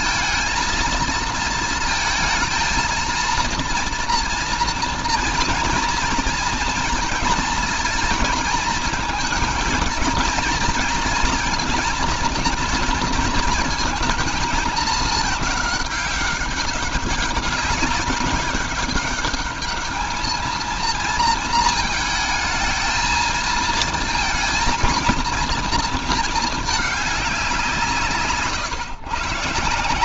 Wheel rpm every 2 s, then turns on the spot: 220, 230, 230, 220, 210, 220, 230, 220, 200, 200, 230, 220, 220, 220, 130.
none